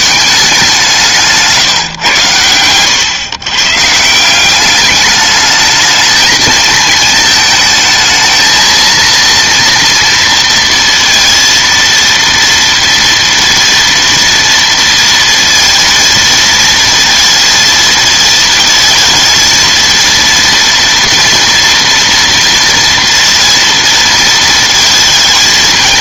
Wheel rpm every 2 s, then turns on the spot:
190, 100, 200, 220, 230, 230, 230, 230, 230, 230, 230, 230, 230.
2-4